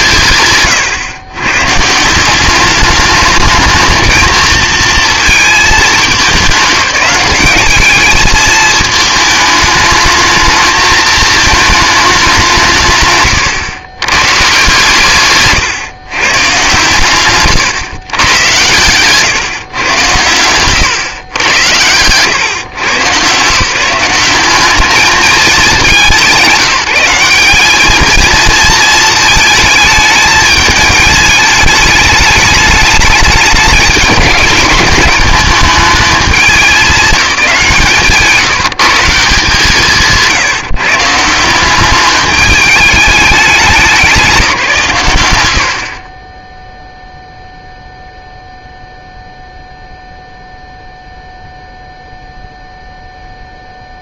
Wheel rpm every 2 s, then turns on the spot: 130, 200, 230, 200, 220, 220, 140, 160, 130, 130, 120, 130, 200, 180, 220, 220, 210, 200, 210, 170, 160, 210, 150, 0, 0, 0, 0.
none